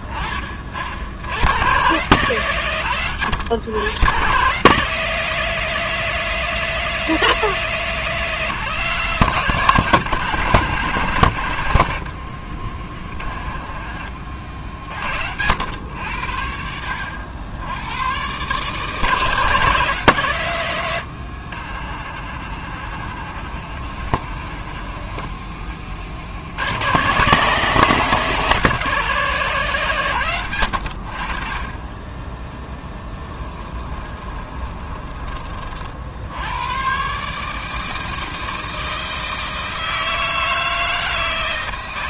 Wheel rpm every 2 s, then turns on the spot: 70, 120, 160, 170, 170, 140, 40, 70, 80, 160, 80, 60, 40, 130, 160, 70, 10, 30, 130, 160, 160.
12-14 22-26 32-36